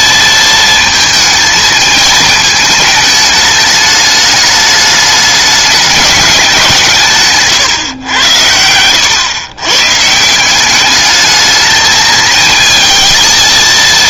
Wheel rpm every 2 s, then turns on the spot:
220, 220, 210, 170, 100, 190, 220.
none